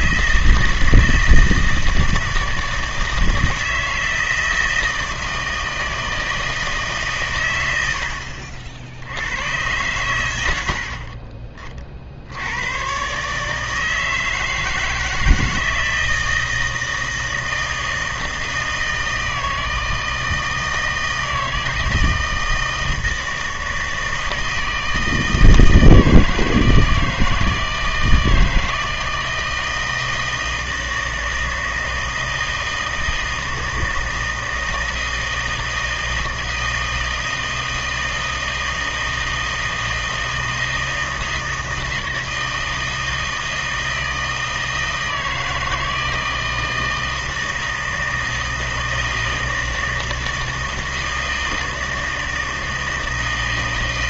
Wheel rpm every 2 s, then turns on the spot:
160, 160, 160, 160, 60, 90, 90, 160, 160, 160, 160, 160, 160, 160, 160, 160, 160, 160, 160, 160, 160, 160, 160, 160, 160, 160, 160.
none